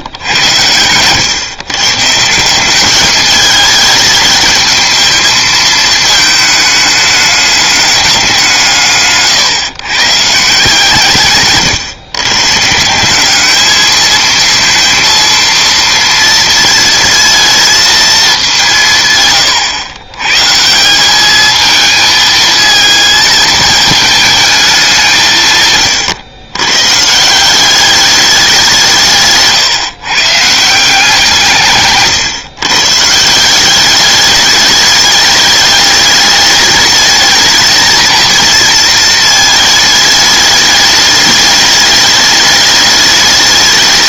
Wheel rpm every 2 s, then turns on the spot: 100, 190, 220, 220, 170, 150, 140, 230, 230, 180, 160, 220, 210, 120, 190, 160, 140, 210, 210, 220, 210, 210.
none